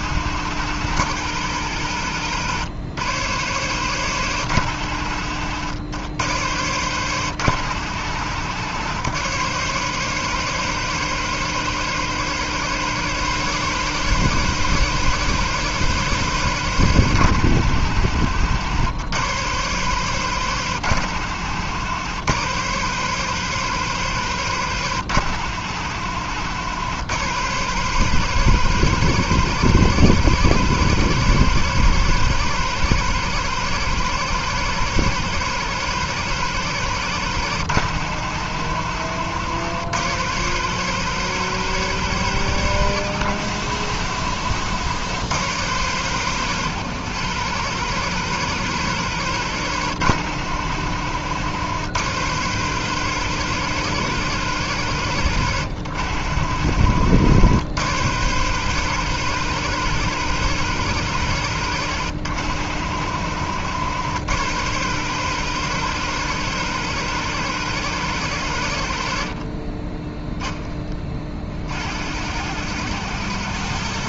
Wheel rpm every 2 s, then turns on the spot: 100, 110, 100, 120, 110, 130, 130, 130, 120, 100, 110, 120, 120, 110, 130, 130, 130, 130, 120, 90, 130, 120, 100, 120, 130, 90, 130, 120, 90, 130, 130, 90, 120, 130, 90, 30, 100.
none